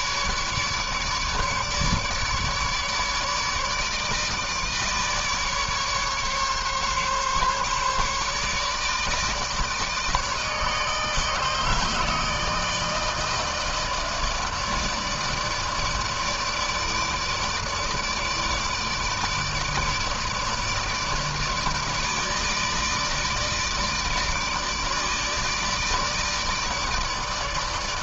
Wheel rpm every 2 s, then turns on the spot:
150, 150, 150, 140, 150, 160, 160, 150, 150, 150, 150, 150, 150, 150.
none